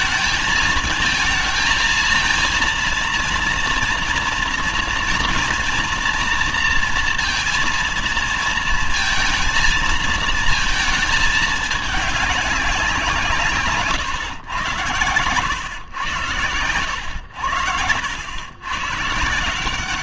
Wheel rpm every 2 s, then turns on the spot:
220, 230, 230, 230, 230, 220, 200, 130, 110, 110.
none